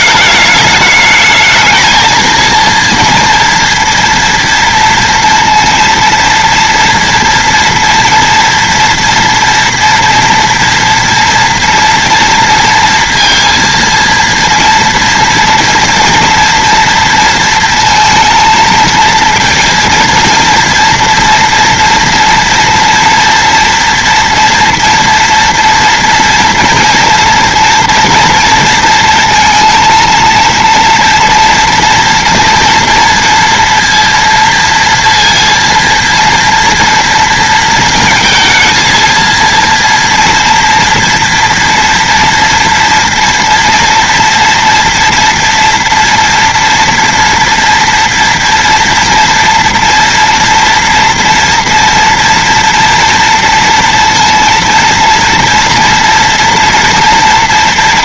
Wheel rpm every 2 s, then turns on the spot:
210, 240, 230, 230, 230, 240, 230, 230, 230, 230, 230, 230, 230, 230, 230, 230, 240, 230, 230, 220, 230, 230, 230, 230, 230, 230, 240, 230, 230.
none